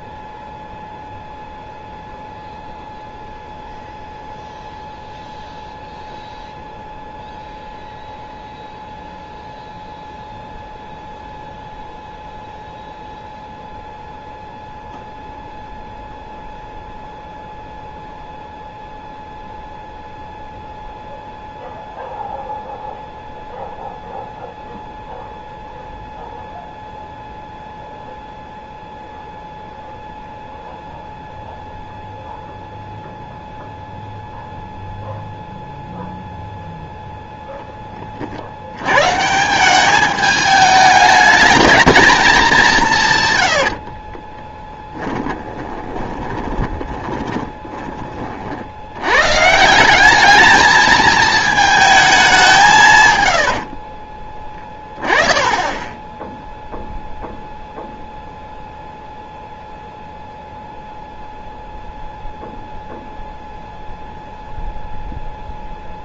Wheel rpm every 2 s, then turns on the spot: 0, 0, 0, 0, 0, 0, 0, 0, 0, 0, 0, 0, 0, 0, 0, 0, 0, 0, 0, 60, 210, 200, 10, 20, 70, 210, 180, 20, 0, 0, 0, 0, 0.
44-48